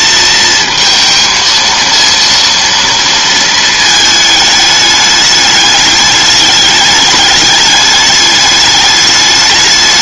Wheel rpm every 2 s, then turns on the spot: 220, 230, 210, 210, 210.
none